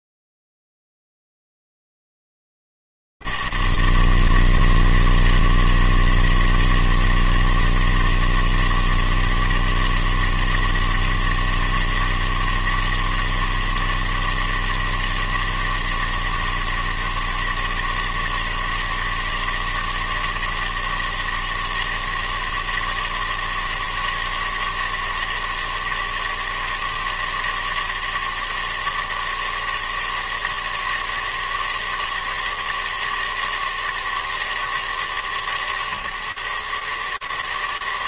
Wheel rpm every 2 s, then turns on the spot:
100, 160, 160, 160, 160, 160, 160, 160, 160, 160, 160, 160, 160, 160, 160, 160, 160, 150, 150.
none